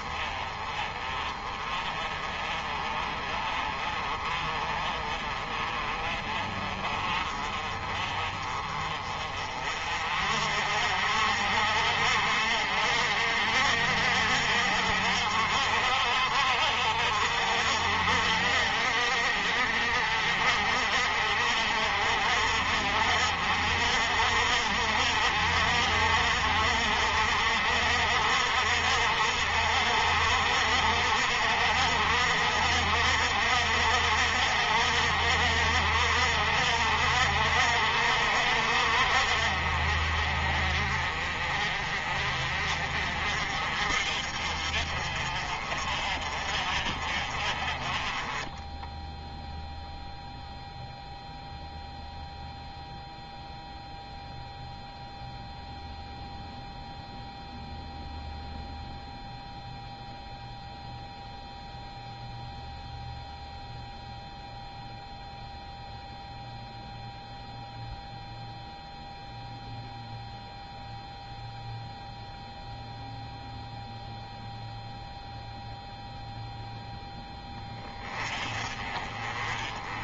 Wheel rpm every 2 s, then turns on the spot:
30, 30, 30, 30, 30, 50, 60, 60, 50, 50, 60, 60, 60, 60, 60, 60, 60, 60, 60, 50, 40, 40, 40, 40, 0, 0, 0, 0, 0, 0, 0, 0, 0, 0, 0, 0, 0, 0, 0, 30.
none